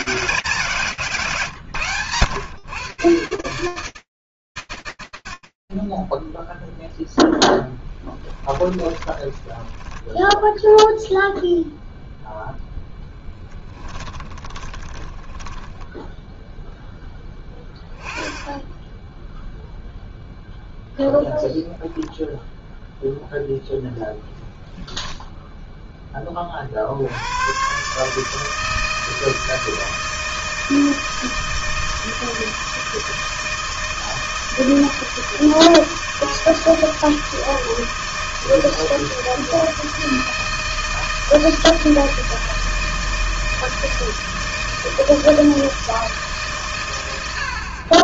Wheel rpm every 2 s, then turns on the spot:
170, 120, 120, 0, 10, 0, 10, 20, 10, 0, 10, 0, 10, 140, 160, 160, 160, 160, 160, 160, 160, 160, 160, 40.
8-10 12-14